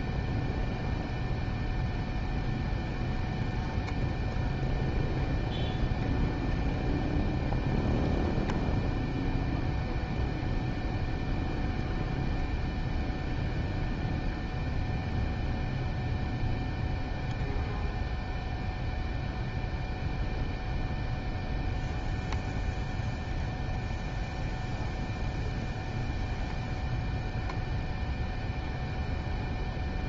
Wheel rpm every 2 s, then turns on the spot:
0, 0, 0, 0, 0, 0, 0, 0, 0, 0, 0, 0, 0, 0, 0.
none